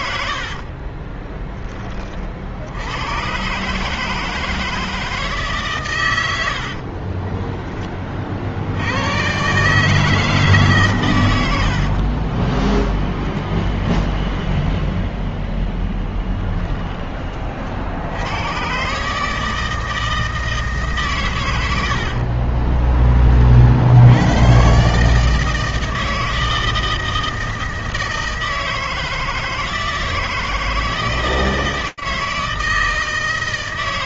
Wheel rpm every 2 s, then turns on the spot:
70, 60, 160, 90, 60, 150, 20, 0, 10, 110, 160, 40, 110, 160, 160, 160, 160.
0-2 6-8 12-14 22-24